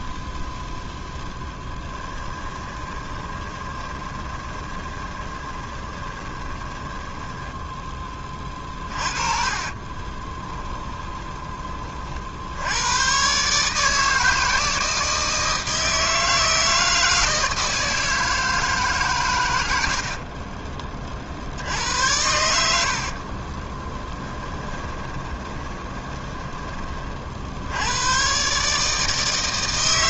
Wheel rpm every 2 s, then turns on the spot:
10, 20, 20, 10, 30, 20, 110, 160, 160, 140, 30, 60, 20, 40, 150.
0-12 22-26